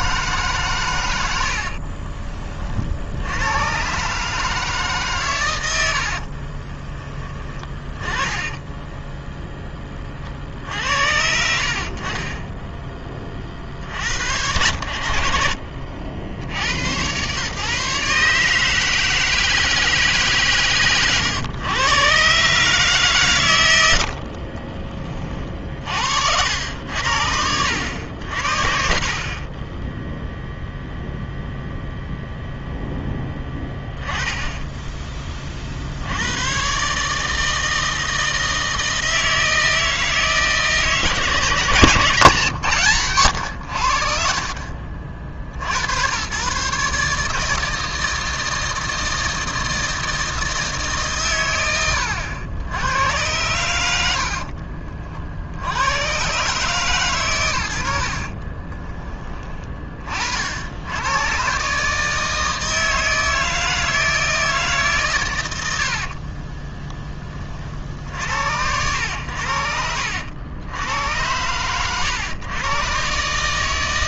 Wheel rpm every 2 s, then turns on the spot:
100, 70, 140, 20, 10, 70, 10, 70, 100, 160, 120, 140, 40, 80, 40, 0, 10, 20, 140, 160, 160, 130, 40, 140, 160, 150, 100, 50, 140, 20, 90, 160, 140, 20, 80, 90, 130.
6-8 58-60